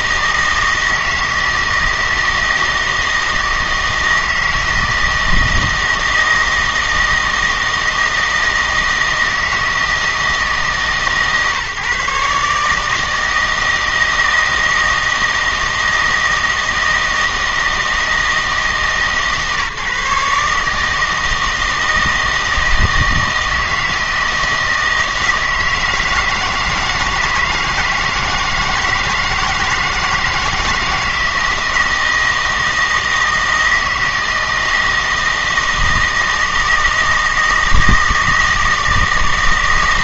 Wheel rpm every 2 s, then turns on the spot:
160, 160, 160, 160, 160, 150, 150, 160, 160, 160, 150, 160, 160, 160, 160, 160, 160, 160, 160, 160.
none